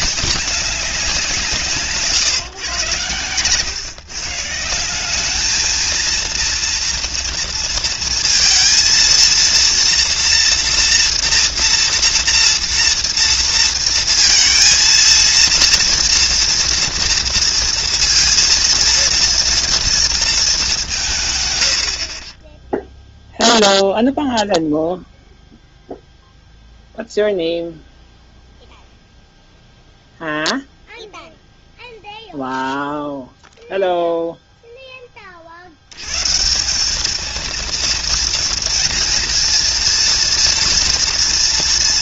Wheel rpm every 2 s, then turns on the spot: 190, 140, 160, 230, 230, 230, 230, 230, 240, 230, 210, 30, 0, 0, 0, 0, 0, 0, 160, 230, 230.
none